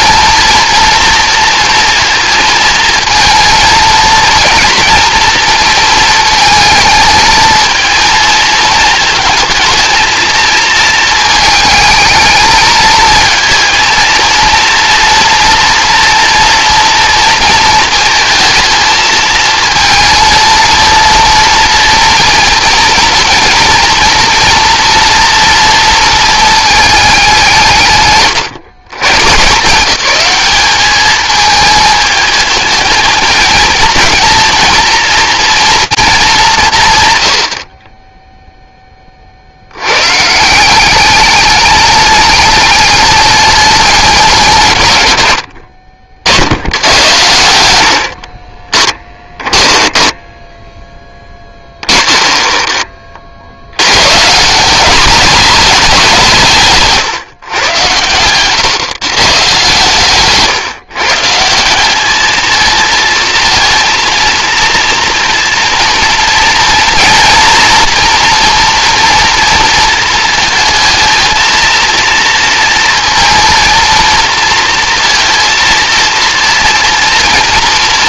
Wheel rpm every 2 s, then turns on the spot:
230, 230, 230, 220, 220, 230, 220, 230, 230, 220, 230, 230, 230, 220, 140, 210, 220, 240, 150, 10, 180, 210, 160, 90, 20, 10, 30, 200, 150, 140, 150, 230, 230, 230, 230, 220, 230, 230, 230.
48-50